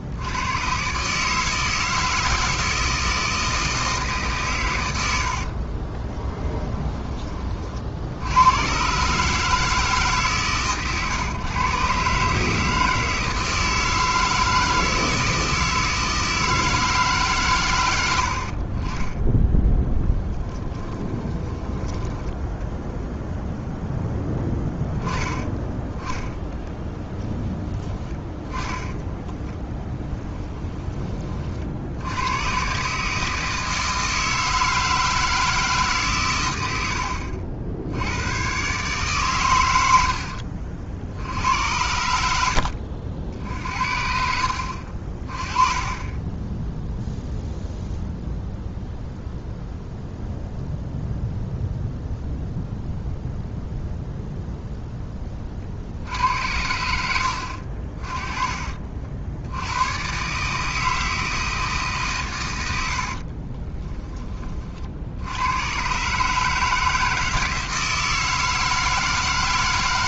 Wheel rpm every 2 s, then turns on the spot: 120, 160, 110, 10, 120, 130, 160, 160, 160, 30, 10, 0, 10, 20, 10, 20, 130, 160, 90, 130, 60, 60, 50, 0, 0, 0, 0, 0, 80, 40, 160, 90, 50, 160, 160.
20-22 26-30 62-64